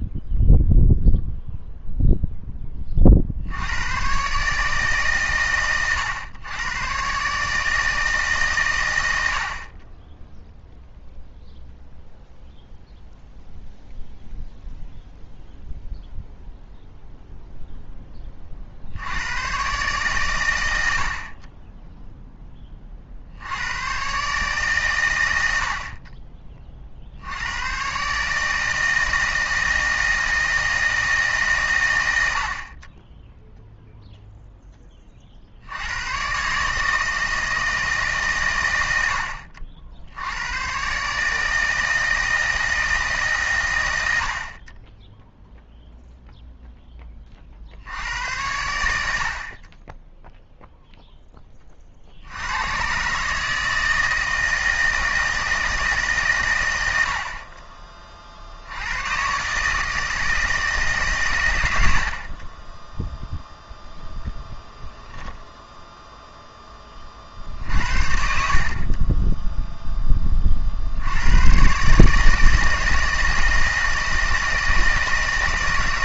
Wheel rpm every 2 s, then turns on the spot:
0, 10, 140, 110, 140, 0, 0, 0, 0, 60, 90, 20, 140, 40, 160, 160, 30, 0, 130, 100, 110, 160, 30, 0, 100, 0, 100, 160, 110, 70, 150, 10, 0, 10, 40, 50, 160, 160.
none